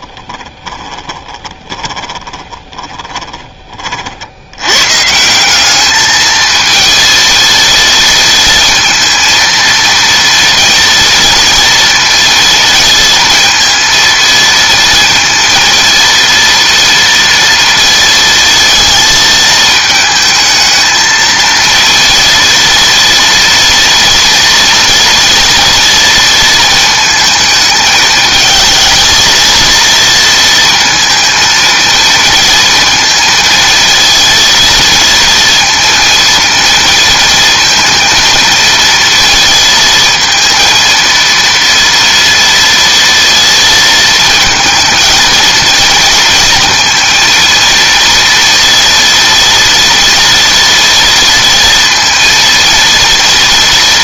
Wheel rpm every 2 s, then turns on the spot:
30, 20, 120, 220, 230, 230, 230, 220, 230, 230, 220, 230, 230, 220, 220, 230, 230, 230, 230, 230, 230, 230, 220, 230, 230, 230, 230.
0-4